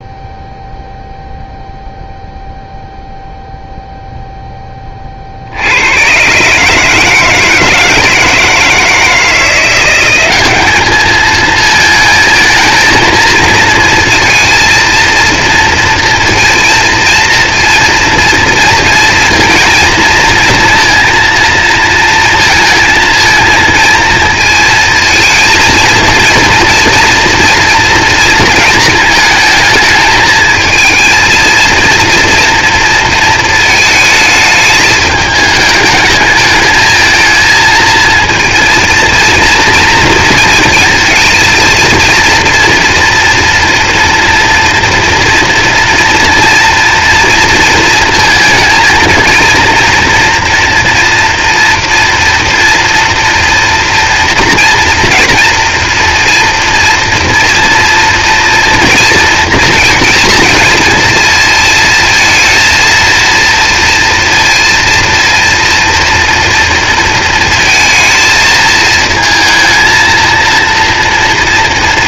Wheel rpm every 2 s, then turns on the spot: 0, 0, 30, 150, 160, 210, 230, 230, 230, 230, 230, 220, 220, 230, 220, 230, 230, 220, 220, 230, 230, 230, 230, 230, 230, 230, 230, 230, 230, 230, 230, 230, 230, 230, 220, 230.
none